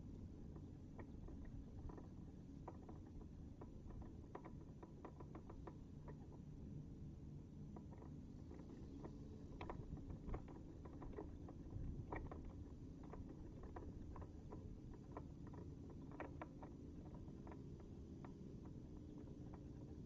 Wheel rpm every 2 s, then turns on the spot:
0, 0, 0, 0, 0, 0, 0, 0, 0, 0.
none